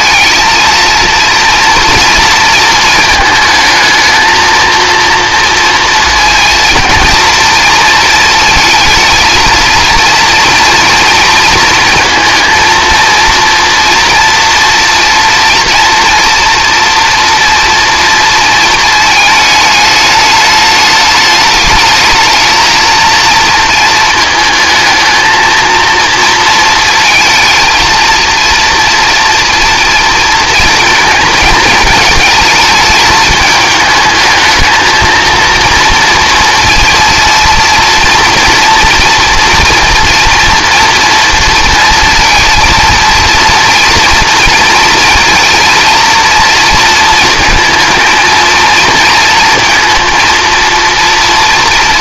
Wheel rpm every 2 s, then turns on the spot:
230, 220, 230, 230, 230, 230, 230, 230, 230, 220, 210, 230, 220, 220, 230, 230, 220, 230, 230, 230, 230, 230, 230, 230, 230, 230.
none